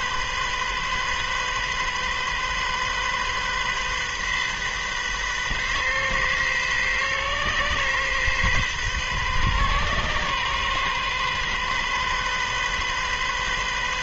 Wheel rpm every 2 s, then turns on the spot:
130, 130, 130, 130, 130, 130, 130.
none